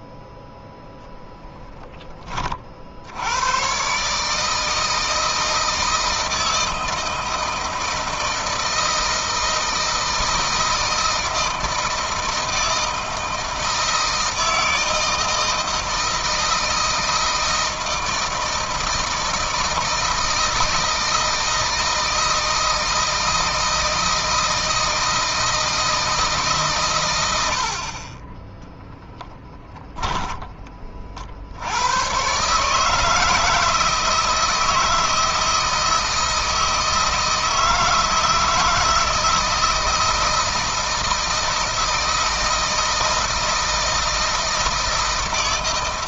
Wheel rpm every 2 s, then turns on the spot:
10, 60, 160, 160, 160, 160, 160, 160, 170, 160, 160, 160, 160, 120, 20, 30, 150, 160, 160, 160, 160, 160, 160.
28-30